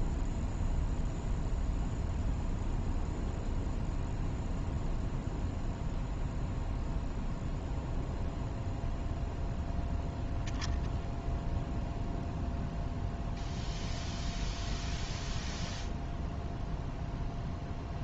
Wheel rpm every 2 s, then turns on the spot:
0, 0, 0, 0, 0, 0, 0, 0, 0.
none